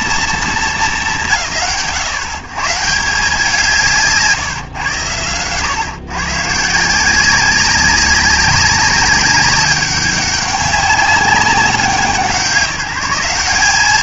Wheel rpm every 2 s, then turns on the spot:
190, 140, 120, 160, 200, 200, 190.
none